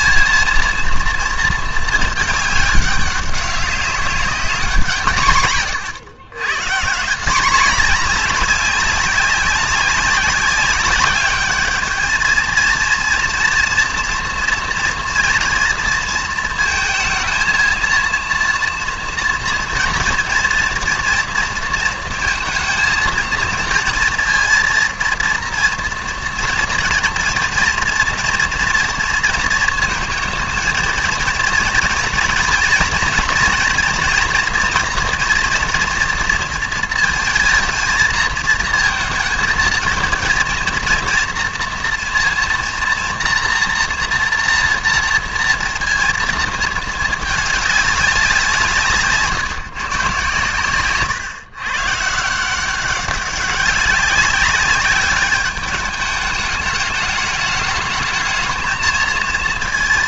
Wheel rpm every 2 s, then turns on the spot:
230, 210, 200, 130, 200, 200, 230, 230, 230, 230, 230, 230, 230, 230, 230, 230, 230, 240, 230, 230, 230, 230, 230, 220, 170, 130, 180, 200, 210, 220.
none